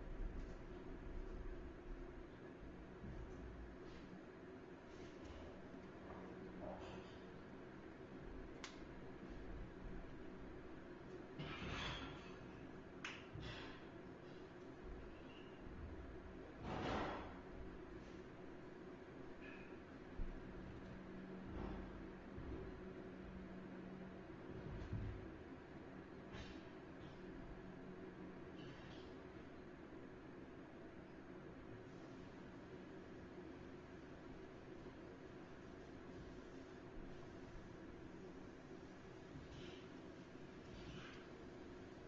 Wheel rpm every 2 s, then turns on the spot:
0, 0, 0, 0, 0, 0, 0, 0, 0, 0, 0, 0, 0, 0, 0, 0, 0, 0, 0, 0, 0.
none